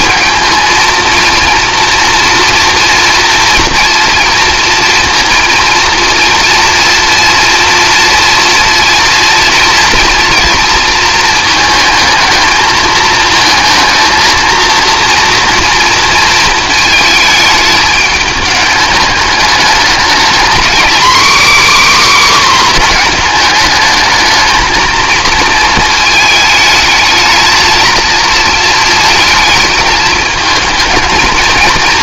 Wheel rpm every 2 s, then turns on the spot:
230, 240, 230, 230, 230, 230, 220, 230, 220, 210, 250, 250, 230, 220, 230, 220.
none